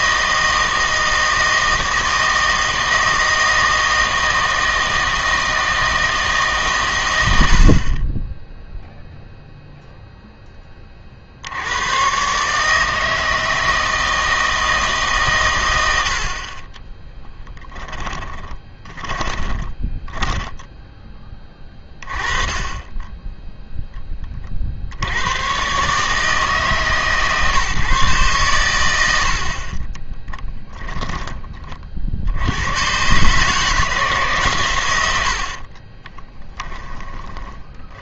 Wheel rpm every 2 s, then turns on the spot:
160, 160, 160, 130, 0, 20, 150, 160, 30, 20, 10, 20, 50, 150, 100, 10, 100, 120, 10.
16-20 30-32 34-38